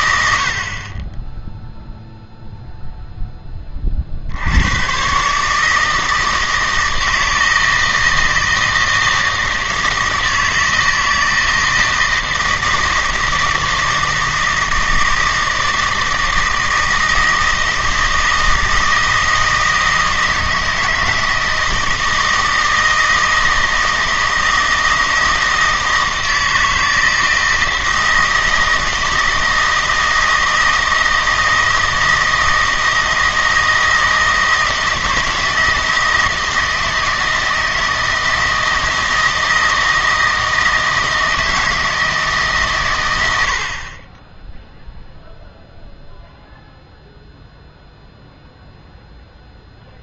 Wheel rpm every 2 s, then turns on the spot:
40, 0, 110, 160, 160, 160, 160, 160, 160, 160, 160, 160, 160, 160, 160, 160, 160, 160, 160, 160, 160, 130, 0, 0, 0.
none